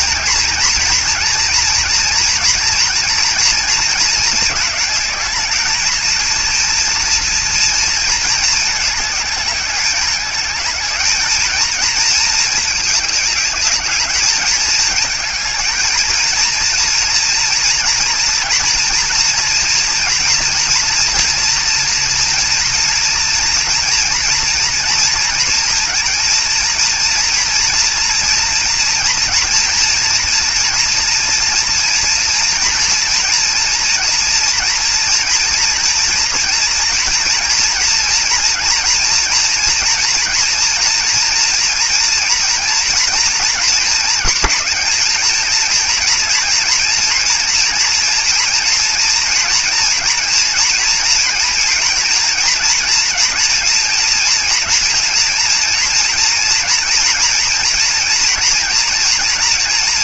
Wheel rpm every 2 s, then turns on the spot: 240, 230, 220, 230, 220, 210, 210, 210, 230, 230, 230, 230, 230, 230, 230, 230, 230, 230, 230, 240, 230, 240, 230, 230, 240, 230, 230, 230, 240, 230.
none